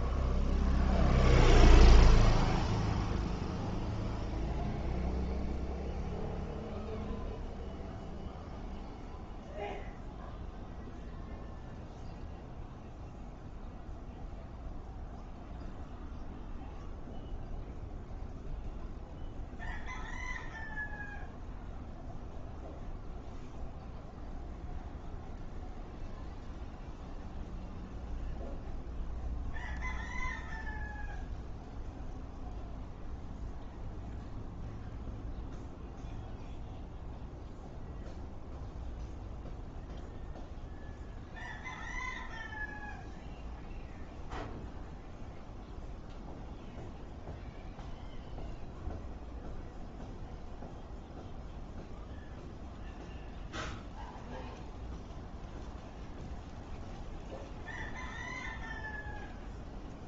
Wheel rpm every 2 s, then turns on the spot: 0, 0, 0, 0, 0, 0, 0, 0, 0, 0, 0, 0, 0, 0, 0, 0, 0, 0, 0, 0, 0, 0, 0, 0, 0, 0, 0, 0, 0, 0.
none